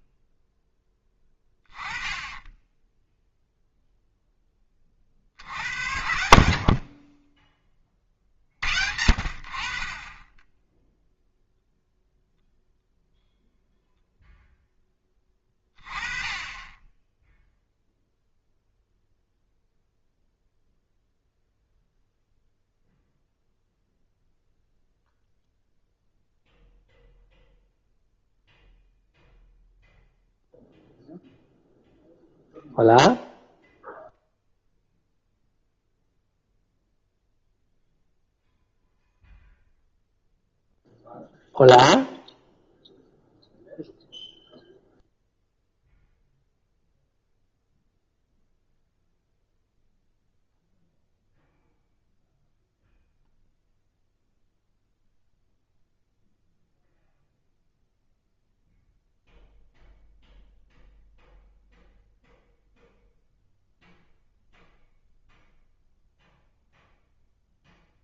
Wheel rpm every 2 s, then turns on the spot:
10, 10, 20, 60, 60, 0, 0, 10, 10, 0, 0, 0, 0, 0, 0, 0, 0, 0, 0, 0, 0, 0, 0, 0, 0, 0, 0, 0, 0, 0, 0, 0, 0, 0.
none